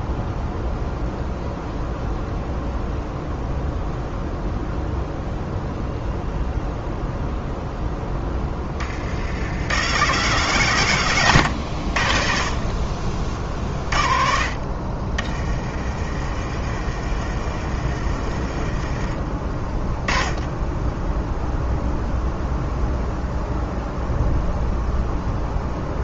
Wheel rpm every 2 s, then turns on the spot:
0, 0, 0, 0, 20, 140, 40, 40, 40, 30, 10, 0, 0.
16-20